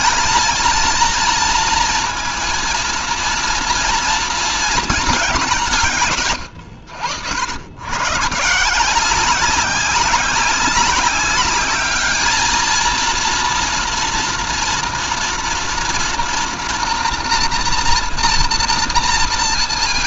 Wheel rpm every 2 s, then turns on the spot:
230, 230, 230, 90, 160, 200, 220, 230, 230, 230.
none